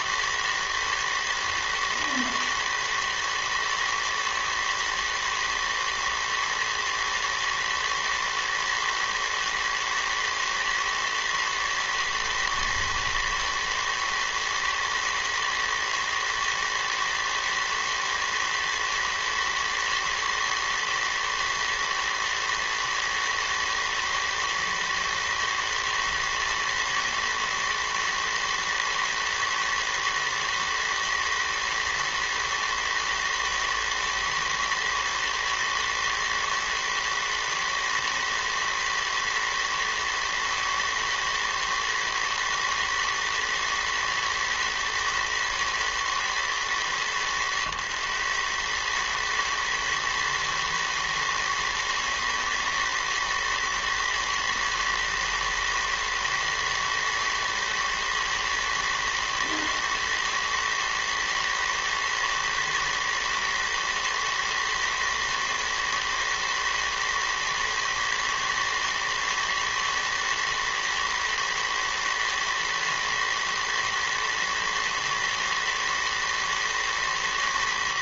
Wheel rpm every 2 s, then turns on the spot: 110, 110, 110, 110, 120, 110, 110, 110, 110, 110, 110, 110, 110, 110, 110, 110, 110, 110, 120, 110, 110, 110, 110, 110, 110, 110, 110, 120, 110, 110, 110, 110, 110, 110, 110, 110, 120, 120, 110.
none